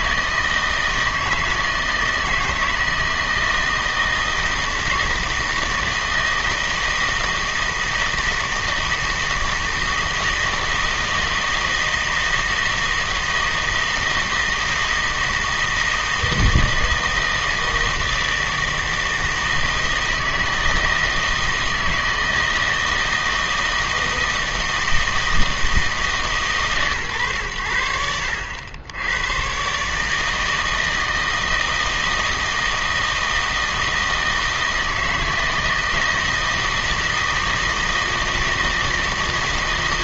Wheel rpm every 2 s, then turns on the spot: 160, 160, 160, 160, 160, 160, 160, 160, 160, 160, 160, 160, 160, 140, 80, 160, 160, 160, 160, 160.
none